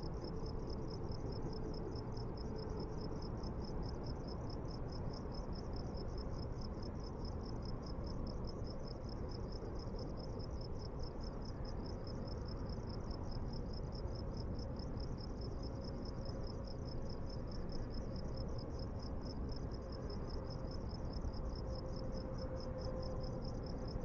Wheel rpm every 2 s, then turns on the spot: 0, 0, 0, 0, 0, 0, 0, 0, 0, 0, 0, 0.
none